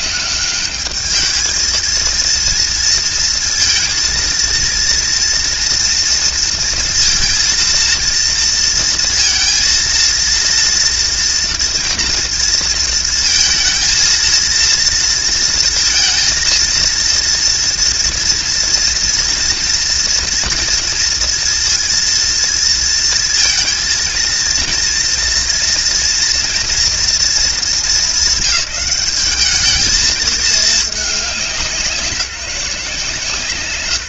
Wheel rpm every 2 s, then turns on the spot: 210, 230, 230, 230, 230, 230, 230, 230, 230, 230, 230, 230, 230, 230, 200, 210, 180.
none